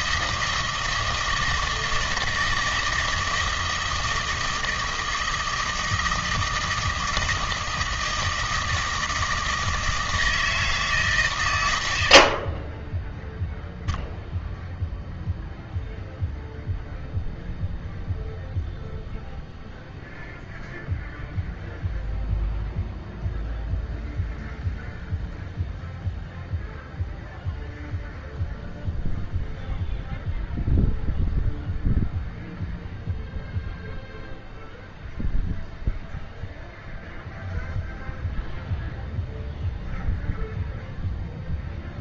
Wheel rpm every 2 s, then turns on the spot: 160, 160, 160, 160, 160, 160, 40, 0, 0, 0, 0, 0, 0, 0, 0, 0, 0, 0, 0, 0, 0.
none